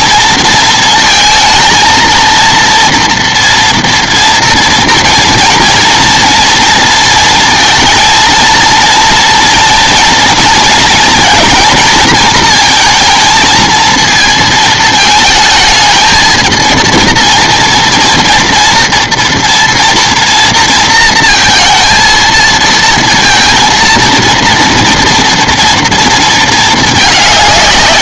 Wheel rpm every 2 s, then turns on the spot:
230, 230, 240, 230, 230, 230, 230, 220, 230, 230, 230, 230, 230, 220.
none